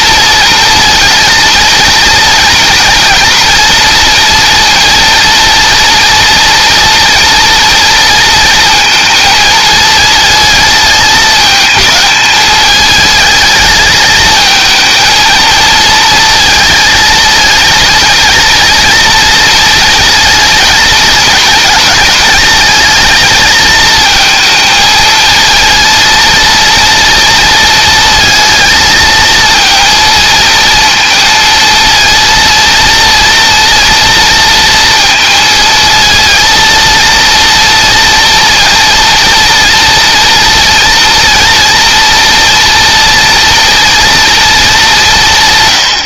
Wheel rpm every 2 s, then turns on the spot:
230, 230, 230, 230, 230, 220, 210, 220, 220, 230, 220, 220, 220, 230, 220, 230, 230, 230, 230, 230, 230, 230, 180.
none